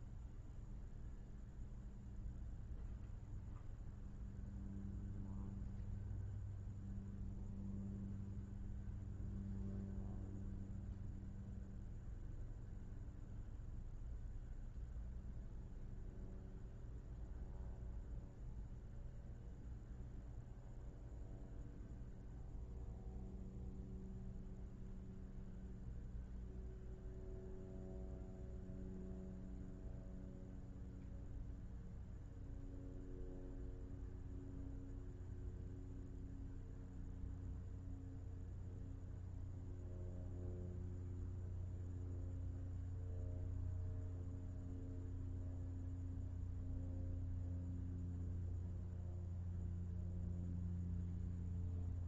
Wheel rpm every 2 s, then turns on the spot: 0, 0, 0, 0, 0, 0, 0, 0, 0, 0, 0, 0, 0, 0, 0, 0, 0, 0, 0, 0, 0, 0, 0, 0, 0, 0.
none